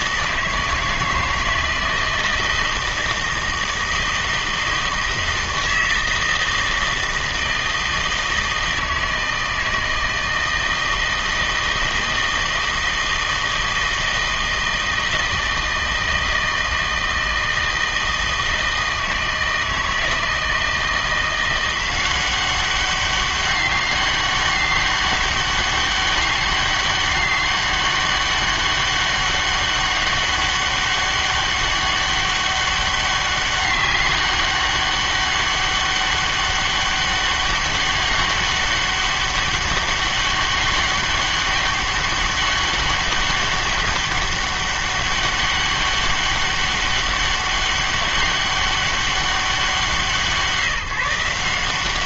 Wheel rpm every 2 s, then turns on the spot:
160, 160, 160, 160, 160, 160, 160, 160, 160, 160, 160, 190, 200, 200, 200, 200, 200, 200, 200, 200, 200, 200, 200, 200, 200, 170.
none